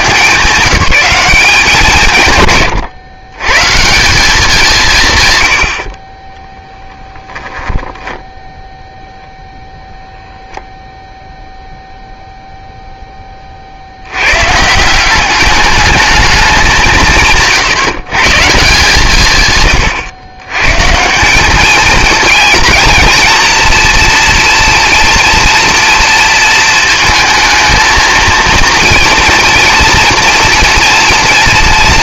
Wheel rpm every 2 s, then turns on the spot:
170, 140, 180, 30, 10, 0, 0, 130, 210, 160, 120, 230, 230, 230, 230, 230.
8-10